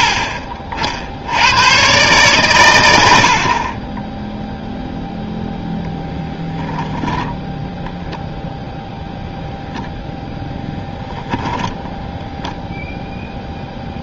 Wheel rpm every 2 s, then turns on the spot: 70, 100, 0, 0, 0, 10, 10.
none